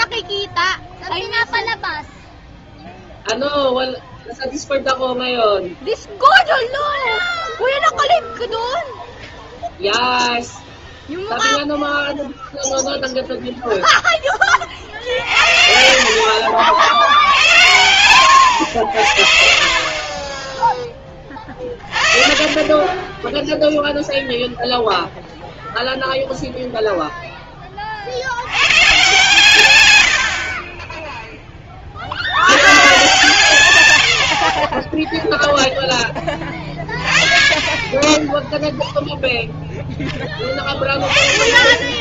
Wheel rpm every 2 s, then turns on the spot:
0, 0, 0, 0, 0, 0, 0, 40, 70, 80, 20, 30, 0, 0, 120, 40, 110, 30, 20, 0, 10.
none